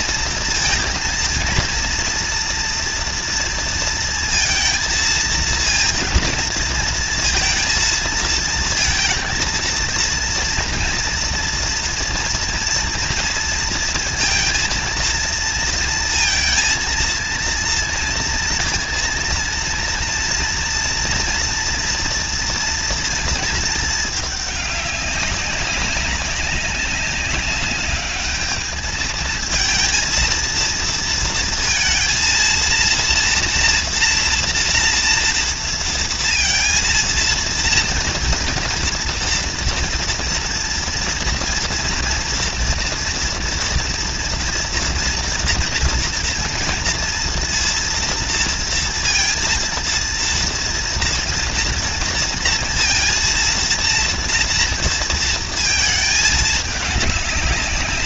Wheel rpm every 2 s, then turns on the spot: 230, 230, 230, 230, 220, 230, 240, 230, 230, 230, 230, 230, 210, 190, 210, 230, 230, 230, 230, 230, 230, 230, 230, 240, 230, 230, 230, 230, 220.
none